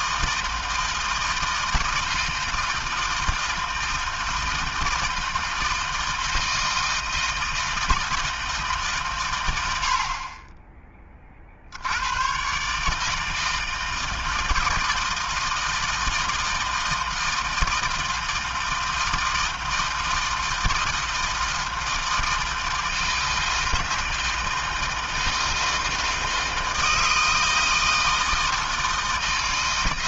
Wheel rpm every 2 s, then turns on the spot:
160, 160, 160, 160, 130, 30, 150, 160, 160, 160, 160, 160, 160, 160, 160.
none